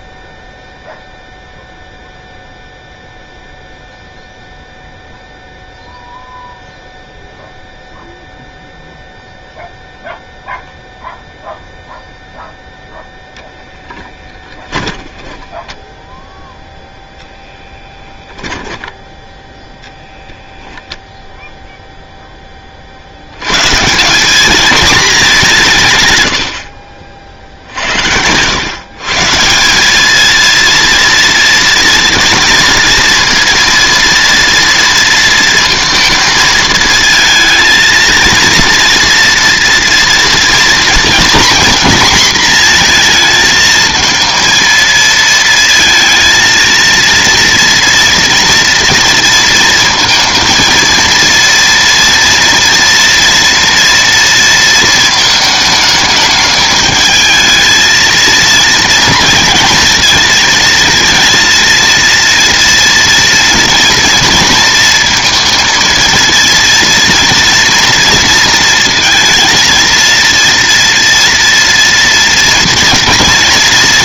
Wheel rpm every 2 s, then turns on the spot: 0, 0, 0, 0, 0, 0, 0, 20, 0, 10, 0, 30, 210, 60, 110, 230, 230, 230, 220, 230, 230, 230, 230, 230, 230, 230, 230, 230, 220, 230, 230, 230, 230, 230, 230, 230, 230.
14-16 18-20